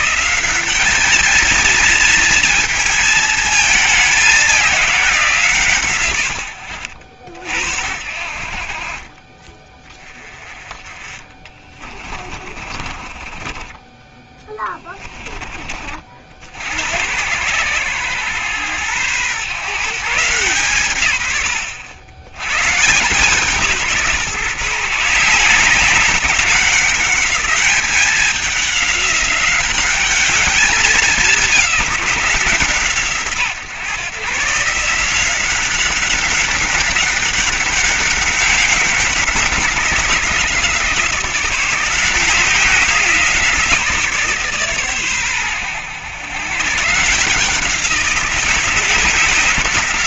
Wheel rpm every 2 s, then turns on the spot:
210, 220, 190, 70, 40, 30, 40, 20, 90, 110, 130, 140, 150, 200, 200, 210, 160, 170, 200, 190, 170, 170, 130, 150, 180.
8-14